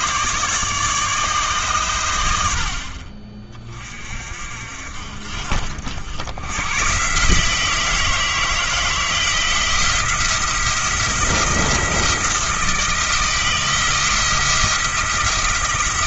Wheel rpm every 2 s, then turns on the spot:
150, 40, 60, 130, 160, 170, 160, 170.
none